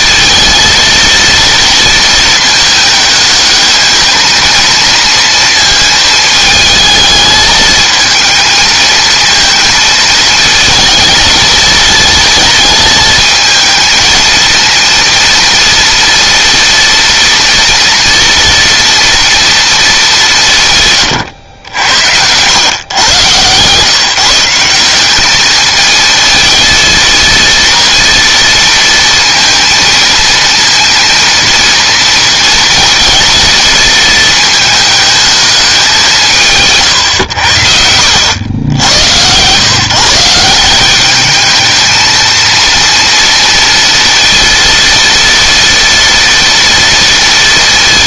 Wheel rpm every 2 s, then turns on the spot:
230, 220, 230, 220, 230, 230, 220, 230, 230, 230, 130, 110, 190, 230, 230, 230, 230, 220, 120, 110, 190, 230, 230, 230.
none